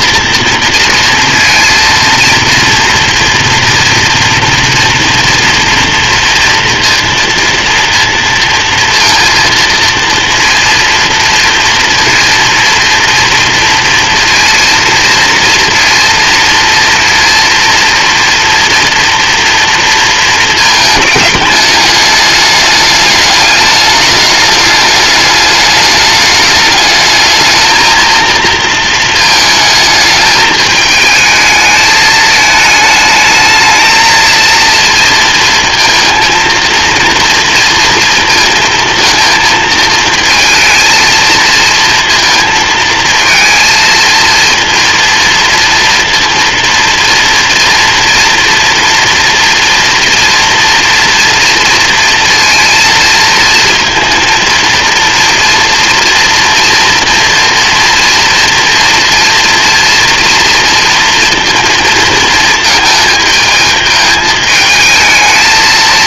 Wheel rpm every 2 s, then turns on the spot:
230, 240, 230, 230, 230, 230, 230, 230, 230, 230, 220, 210, 210, 220, 220, 220, 220, 230, 230, 230, 230, 230, 230, 230, 240, 230, 230, 230, 230, 230, 230, 220, 220.
none